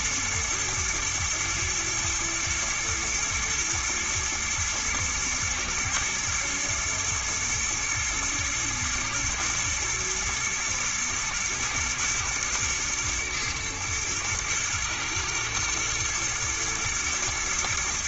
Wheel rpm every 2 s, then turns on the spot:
120, 120, 110, 120, 110, 110, 120, 120, 110.
none